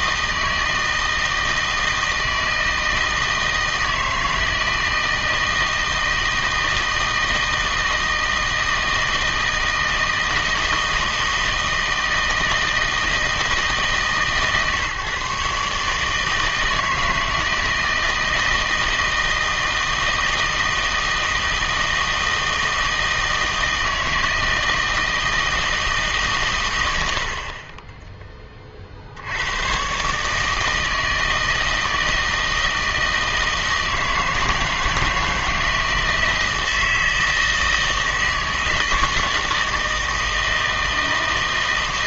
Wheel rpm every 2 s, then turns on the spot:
160, 160, 160, 160, 160, 160, 160, 140, 160, 160, 160, 160, 160, 110, 40, 160, 160, 160, 160, 160, 160.
none